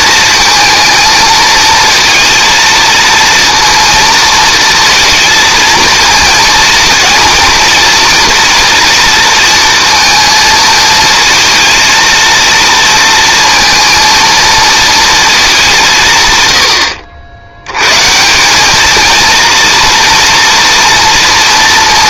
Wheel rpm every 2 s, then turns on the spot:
220, 230, 230, 220, 230, 220, 230, 220, 80, 210, 230.
none